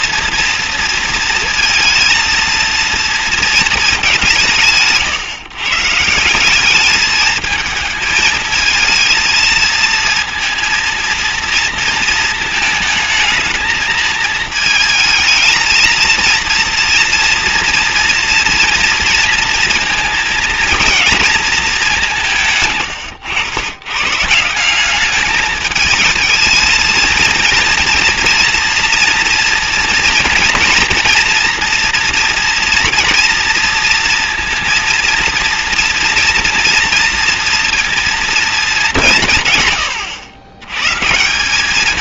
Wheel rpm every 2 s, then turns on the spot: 230, 210, 140, 220, 230, 230, 220, 220, 230, 230, 210, 100, 220, 230, 230, 240, 230, 230, 230, 130, 200.
none